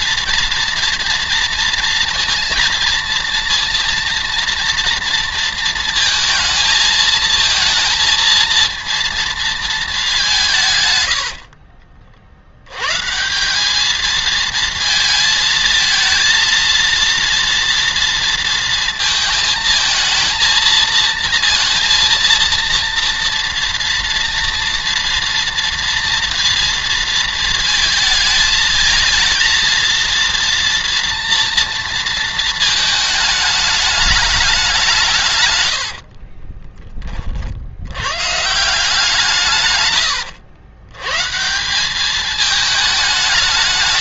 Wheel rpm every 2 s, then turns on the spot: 230, 230, 240, 230, 230, 140, 110, 220, 230, 230, 230, 230, 230, 230, 220, 230, 220, 190, 30, 150, 120, 210.
10-12 36-38